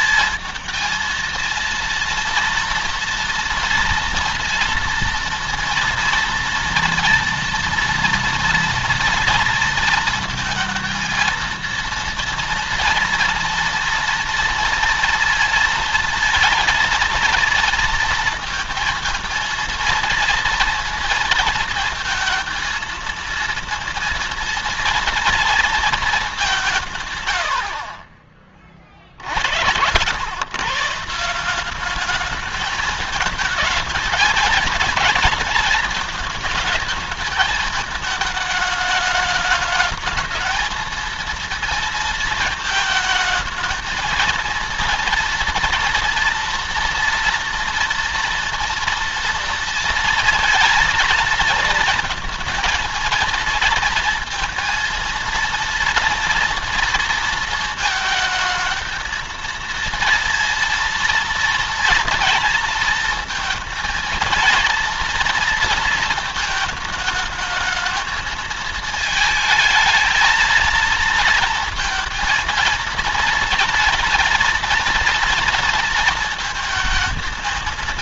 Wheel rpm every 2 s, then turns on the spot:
220, 240, 230, 230, 240, 220, 230, 230, 230, 230, 230, 220, 230, 190, 40, 120, 210, 220, 220, 220, 220, 220, 230, 230, 230, 230, 230, 230, 230, 220, 230, 230, 230, 220, 220, 220, 230, 230, 220.
none